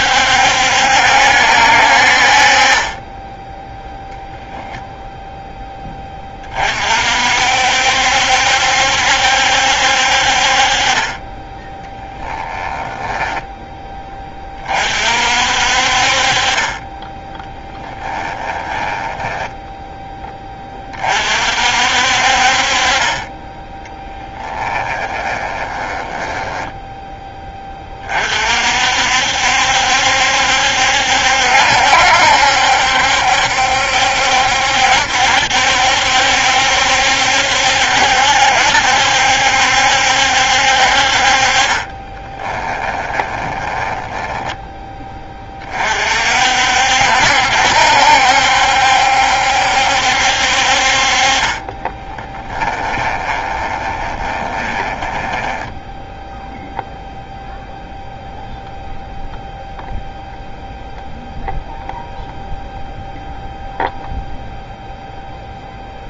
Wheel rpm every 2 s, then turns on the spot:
70, 30, 0, 40, 70, 40, 10, 30, 30, 10, 20, 40, 10, 10, 50, 70, 70, 70, 70, 70, 60, 20, 10, 60, 70, 50, 20, 20, 0, 0, 0, 0, 0.
12-14 18-20 24-28 42-44 52-56